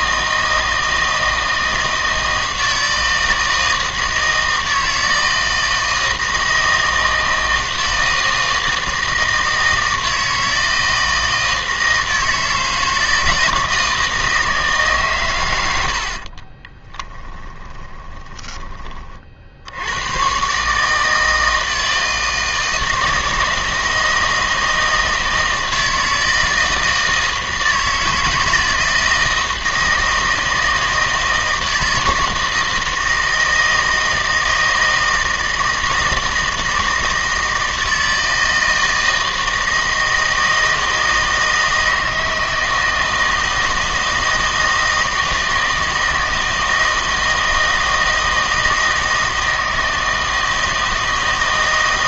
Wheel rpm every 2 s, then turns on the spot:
160, 160, 160, 160, 160, 160, 160, 160, 30, 20, 140, 160, 160, 160, 160, 160, 160, 160, 160, 160, 160, 160, 160, 160, 160, 160.
16-18